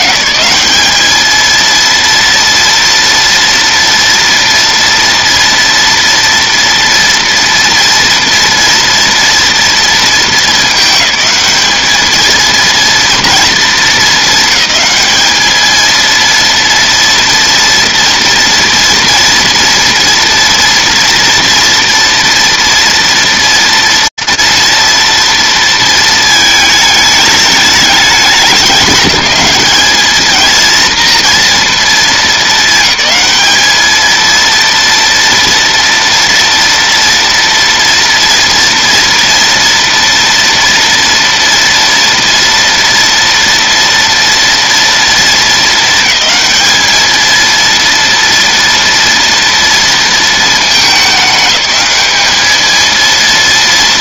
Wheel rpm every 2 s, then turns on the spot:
200, 230, 230, 230, 230, 210, 230, 200, 230, 230, 230, 230, 230, 210, 200, 220, 220, 230, 230, 230, 230, 230, 230, 220, 230, 220, 220.
none